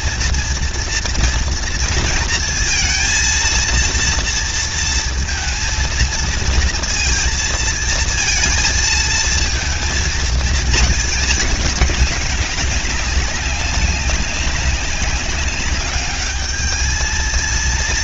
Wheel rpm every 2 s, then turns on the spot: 230, 230, 230, 230, 230, 220, 190, 190, 210.
none